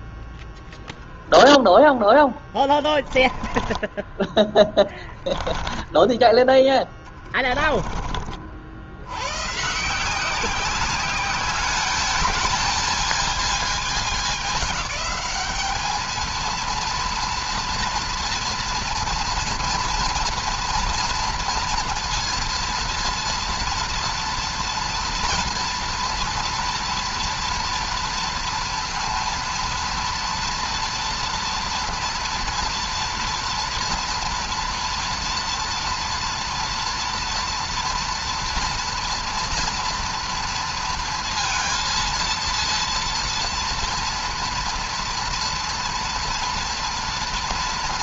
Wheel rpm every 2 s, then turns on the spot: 0, 10, 10, 10, 70, 200, 220, 210, 230, 240, 230, 230, 230, 230, 230, 230, 230, 240, 230, 230, 230, 230, 230, 230.
2-8